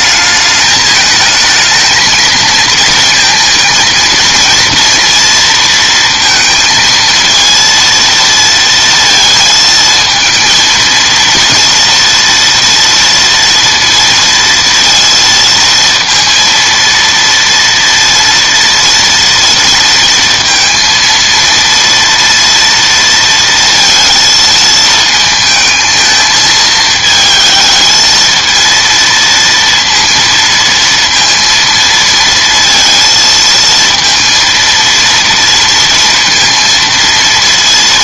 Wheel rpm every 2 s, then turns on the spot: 220, 230, 230, 230, 230, 230, 230, 230, 230, 230, 230, 230, 220, 220, 230, 230, 230, 230, 230.
none